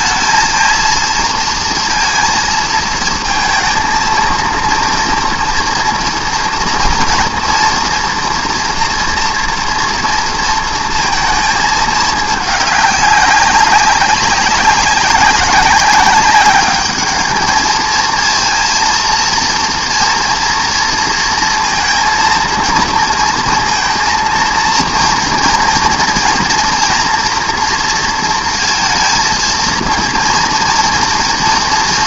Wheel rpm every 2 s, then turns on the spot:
230, 230, 230, 230, 230, 230, 200, 190, 210, 230, 230, 230, 230, 230, 230, 230.
none